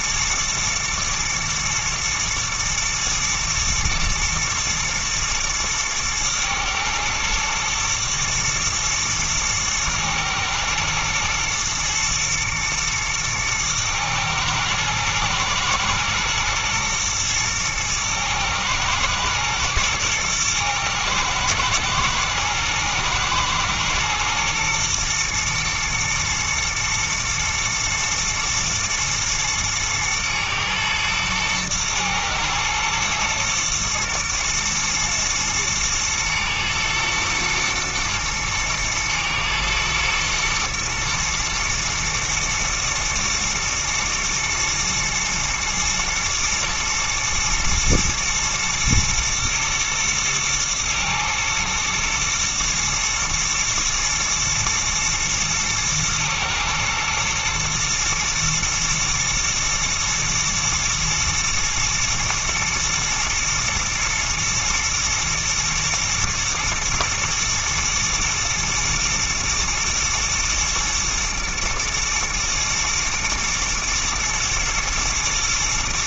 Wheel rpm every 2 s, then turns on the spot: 120, 110, 110, 110, 120, 120, 110, 110, 110, 110, 110, 110, 110, 110, 120, 110, 110, 120, 120, 110, 110, 110, 120, 110, 120, 110, 110, 120, 110, 120, 120, 120, 110, 110, 110, 120, 120, 110.
none